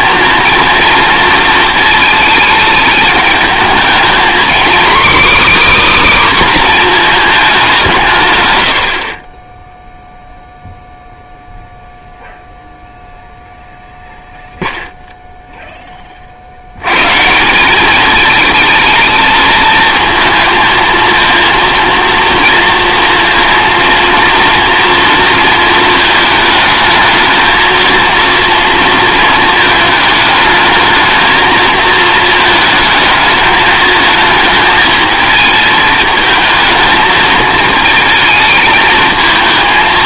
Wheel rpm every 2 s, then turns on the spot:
230, 220, 260, 260, 90, 0, 0, 0, 80, 220, 220, 230, 230, 220, 230, 220, 220, 220, 220, 220.
none